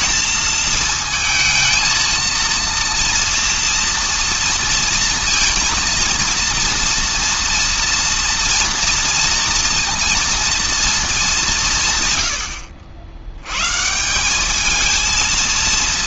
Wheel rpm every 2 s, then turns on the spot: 220, 230, 230, 230, 230, 210, 80, 220.
none